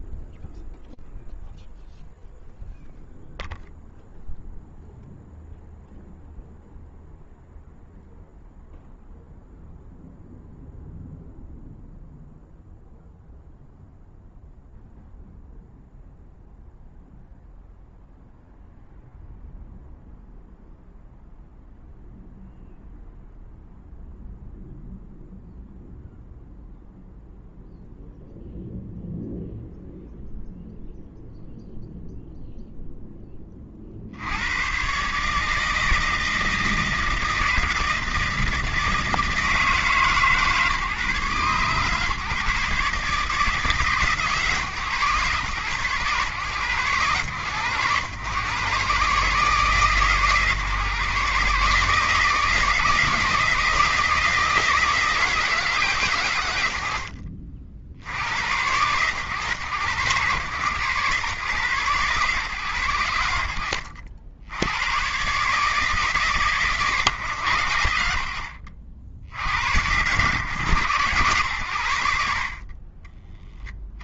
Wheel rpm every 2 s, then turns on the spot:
0, 0, 0, 0, 0, 0, 0, 0, 0, 0, 0, 0, 0, 0, 0, 0, 110, 160, 160, 150, 150, 140, 110, 110, 140, 160, 160, 120, 80, 120, 130, 70, 140, 80, 100, 70, 60.
none